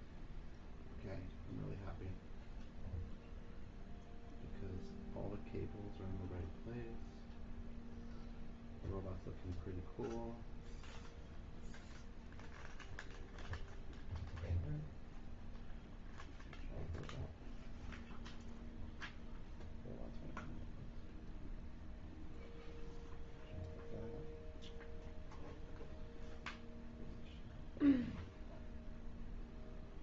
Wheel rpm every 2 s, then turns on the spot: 0, 0, 0, 0, 0, 0, 0, 0, 0, 0, 0, 0, 0, 0, 0.
none